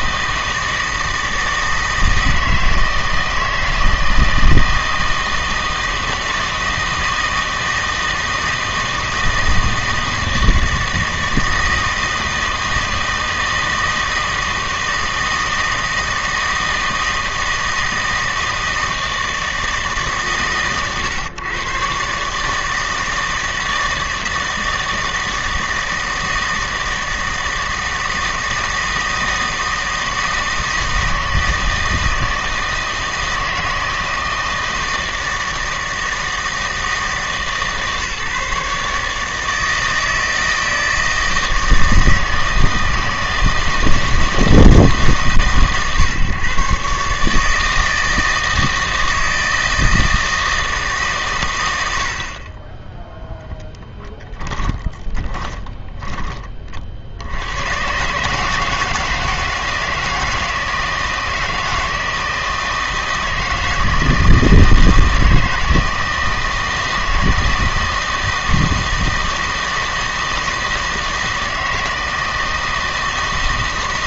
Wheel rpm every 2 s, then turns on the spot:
160, 160, 160, 160, 160, 160, 160, 160, 160, 160, 130, 160, 160, 160, 160, 160, 160, 160, 160, 150, 160, 160, 160, 140, 160, 160, 20, 10, 40, 160, 160, 160, 160, 160, 160, 160, 160.
54-56